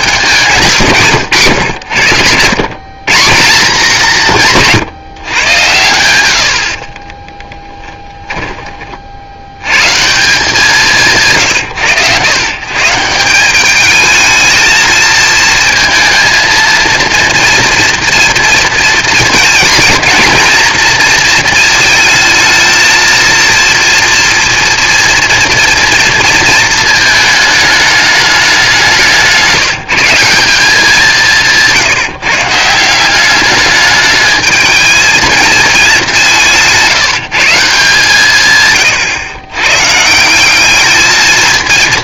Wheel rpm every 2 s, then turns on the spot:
180, 120, 160, 50, 30, 190, 130, 220, 230, 230, 230, 220, 230, 220, 200, 190, 160, 220, 170, 140, 200.
none